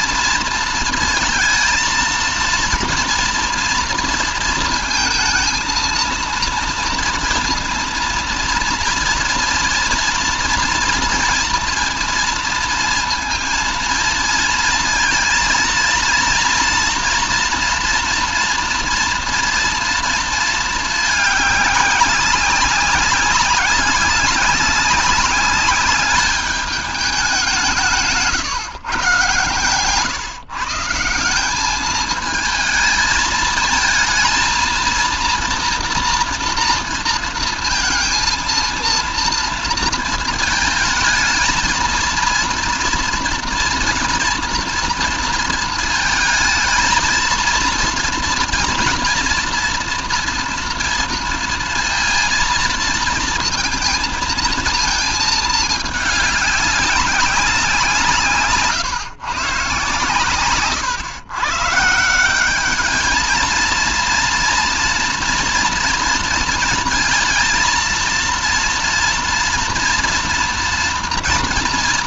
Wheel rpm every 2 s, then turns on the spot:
230, 230, 220, 230, 230, 230, 230, 230, 230, 240, 220, 200, 190, 200, 140, 160, 220, 230, 230, 230, 220, 230, 230, 220, 230, 230, 230, 230, 200, 150, 130, 200, 230, 230, 230, 230.
none